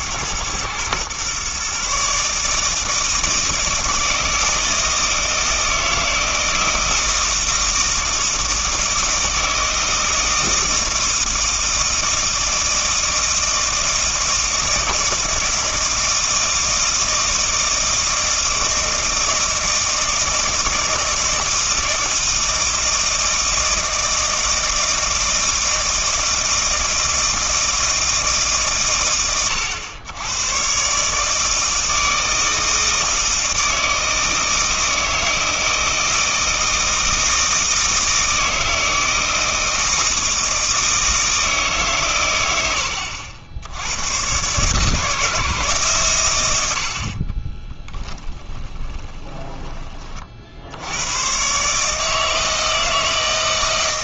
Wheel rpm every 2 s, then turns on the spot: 120, 160, 160, 160, 160, 160, 160, 160, 160, 160, 160, 160, 160, 160, 150, 120, 160, 160, 160, 160, 160, 100, 140, 80, 20, 70, 160.
48-50